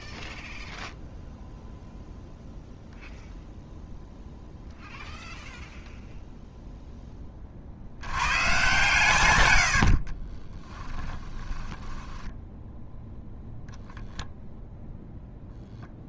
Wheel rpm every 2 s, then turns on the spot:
0, 0, 0, 0, 130, 20, 0, 0.
10-12